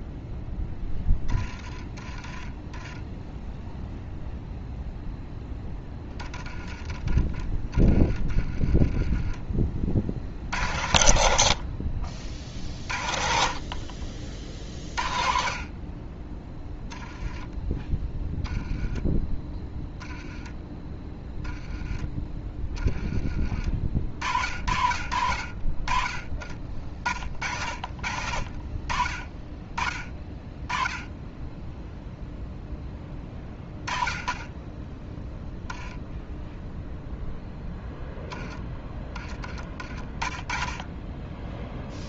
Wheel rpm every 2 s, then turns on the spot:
10, 10, 0, 10, 20, 90, 50, 40, 10, 10, 10, 20, 60, 50, 40, 10, 10, 10, 0, 10, 10.
2-4